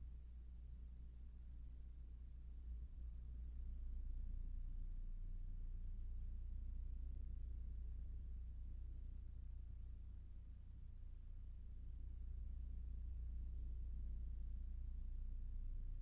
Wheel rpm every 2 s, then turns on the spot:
0, 0, 0, 0, 0, 0, 0, 0.
none